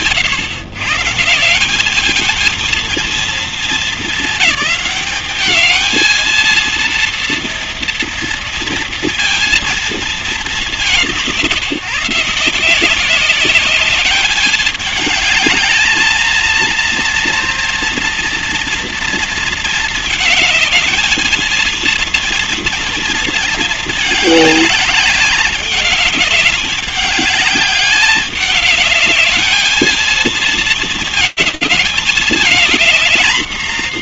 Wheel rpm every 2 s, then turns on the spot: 150, 230, 210, 230, 230, 200, 170, 210, 230, 240, 220, 230, 210, 200, 210, 230, 230.
none